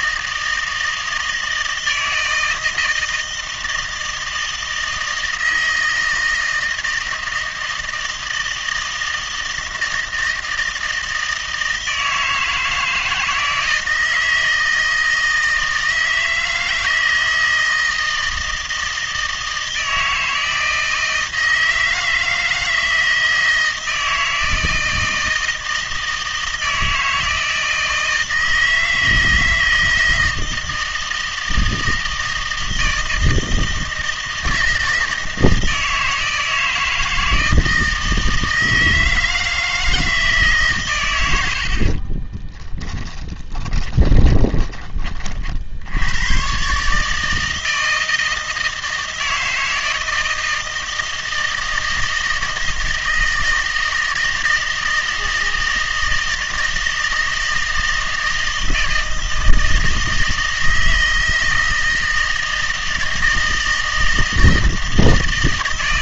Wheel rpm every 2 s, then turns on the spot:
160, 160, 160, 160, 160, 160, 160, 160, 160, 160, 160, 160, 160, 160, 160, 160, 160, 160, 160, 160, 140, 10, 20, 130, 160, 160, 160, 160, 160, 160, 160, 160, 160.
42-46